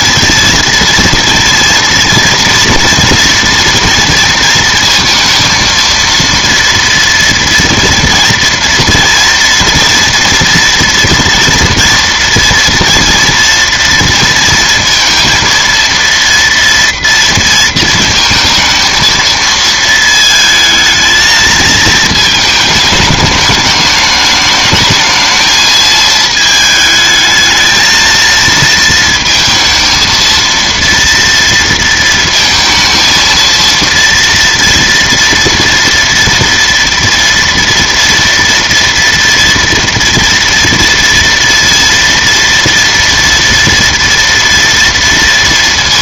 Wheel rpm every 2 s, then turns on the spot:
230, 230, 220, 230, 230, 230, 230, 230, 230, 220, 220, 220, 210, 220, 220, 230, 220, 230, 230, 230, 230, 230, 230.
none